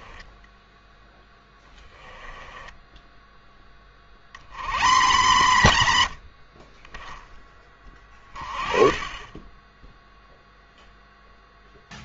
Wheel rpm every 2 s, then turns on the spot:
0, 10, 70, 40, 20, 0.
none